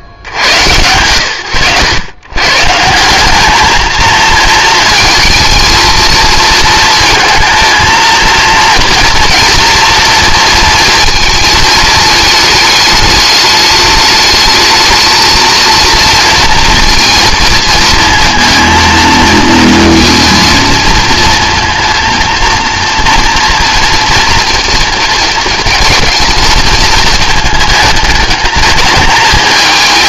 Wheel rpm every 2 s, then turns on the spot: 80, 160, 220, 230, 230, 230, 210, 220, 230, 220, 230, 230, 240, 230, 220.
none